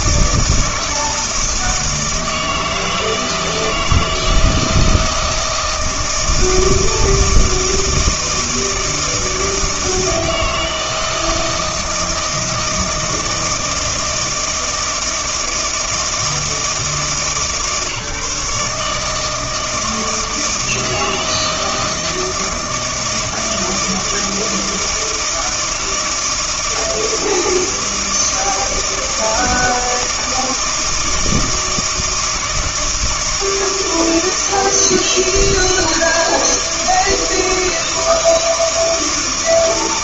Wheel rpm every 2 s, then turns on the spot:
160, 160, 160, 160, 160, 160, 160, 160, 160, 150, 160, 160, 160, 160, 160, 160, 160, 160, 160, 160.
none